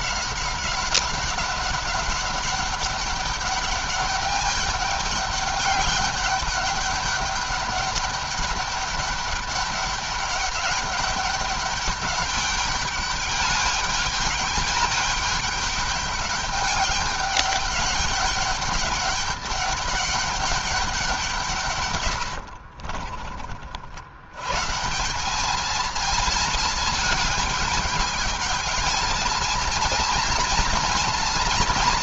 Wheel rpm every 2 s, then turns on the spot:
200, 200, 200, 200, 200, 200, 200, 200, 210, 210, 190, 40, 160, 220, 220, 220.
22-24